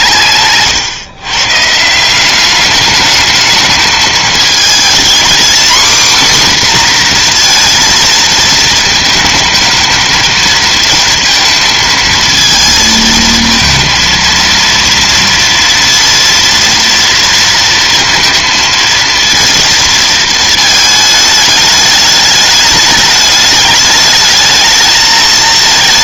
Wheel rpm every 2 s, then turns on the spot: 140, 190, 220, 260, 230, 230, 220, 230, 230, 230, 220, 210, 220.
none